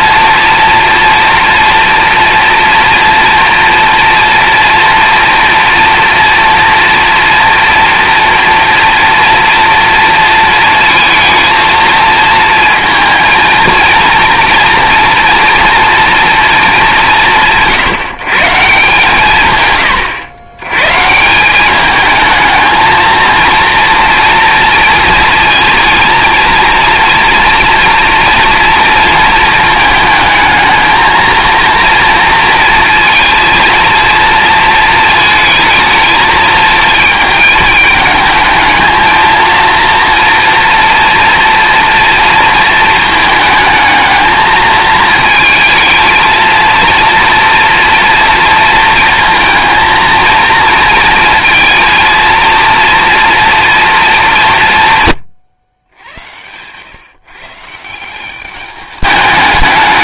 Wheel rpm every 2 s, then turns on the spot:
230, 230, 240, 230, 230, 230, 230, 230, 220, 160, 110, 220, 230, 230, 230, 220, 230, 220, 220, 220, 230, 220, 220, 230, 230, 230, 230, 170, 120, 200.
none